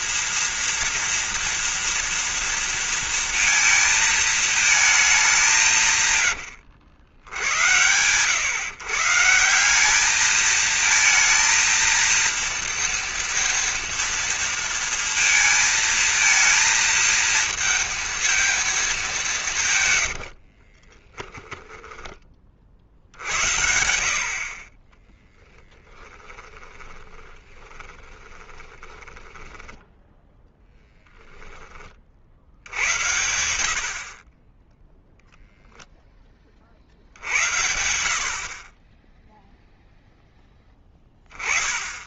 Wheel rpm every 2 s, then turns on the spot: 230, 230, 220, 80, 140, 220, 230, 230, 230, 210, 40, 40, 40, 20, 20, 0, 60, 30, 10, 60, 0.
20-22 26-30